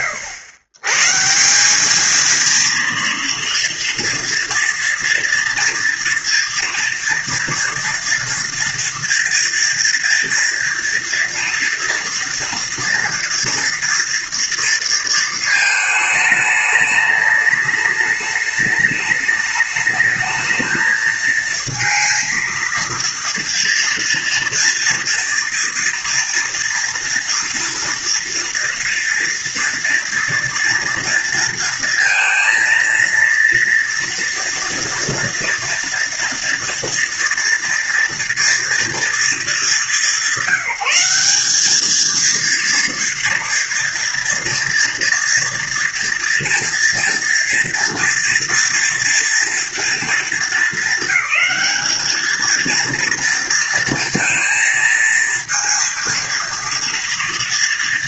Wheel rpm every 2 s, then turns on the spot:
120, 240, 230, 230, 230, 230, 240, 230, 210, 210, 220, 230, 230, 230, 230, 230, 230, 230, 230, 230, 180, 230, 230, 230, 230, 220, 230, 230, 230.
none